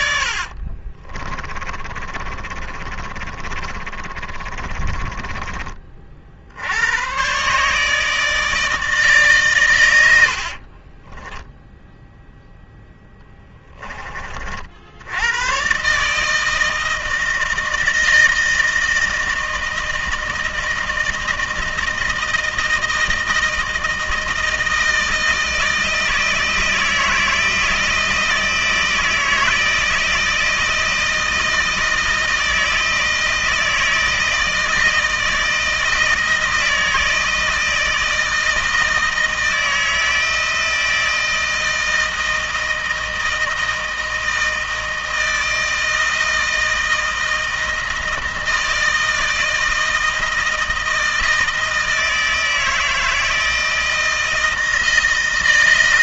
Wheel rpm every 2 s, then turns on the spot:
30, 30, 30, 110, 150, 20, 10, 90, 160, 160, 160, 160, 160, 160, 160, 160, 160, 160, 160, 160, 160, 160, 160, 160, 160, 160, 160, 160.
0-6 10-12